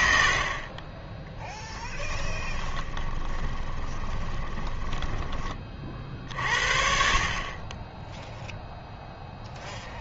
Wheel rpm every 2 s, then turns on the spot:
20, 20, 10, 50, 0.
2-6